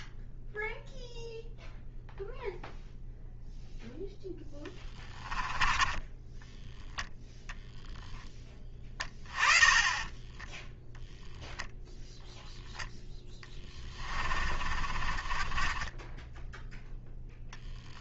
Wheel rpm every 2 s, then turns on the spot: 0, 0, 20, 0, 20, 10, 0, 40, 10.
4-6 8-12 14-16